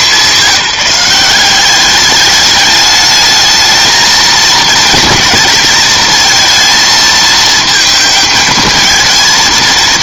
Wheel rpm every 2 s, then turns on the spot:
180, 210, 220, 220, 220.
none